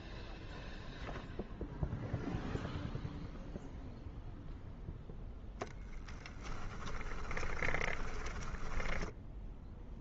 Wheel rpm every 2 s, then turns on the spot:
0, 0, 0, 10, 10.
6-10